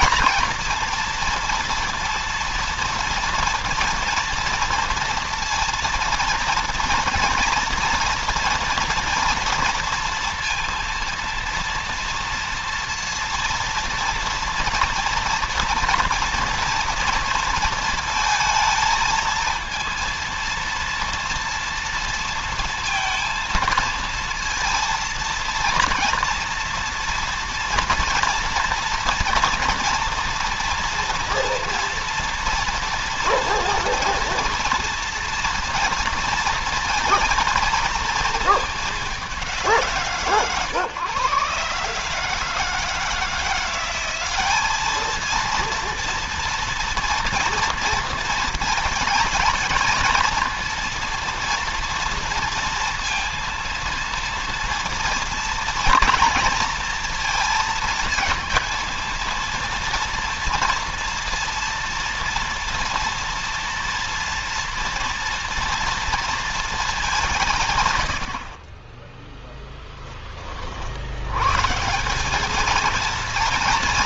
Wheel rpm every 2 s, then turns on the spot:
230, 230, 230, 230, 230, 230, 230, 230, 230, 220, 230, 230, 230, 230, 230, 230, 230, 230, 230, 210, 130, 160, 220, 240, 230, 230, 230, 230, 230, 230, 240, 240, 230, 190, 20, 60, 210.
none